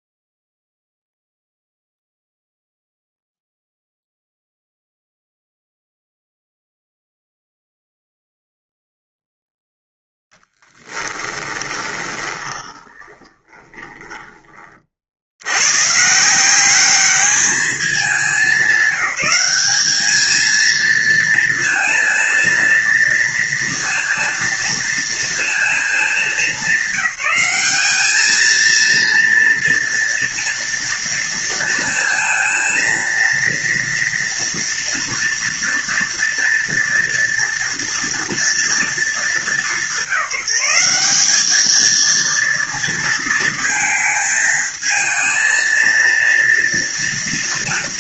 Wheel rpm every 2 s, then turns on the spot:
0, 0, 0, 0, 0, 0, 20, 20, 170, 200, 220, 230, 230, 210, 220, 230, 230, 230, 230, 240, 180, 230, 220, 230.
12-14